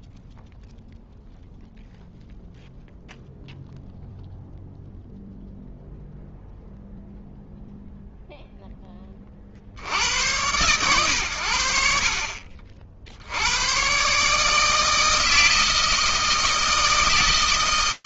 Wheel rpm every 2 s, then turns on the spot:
0, 0, 0, 10, 120, 50, 160, 160, 130.
none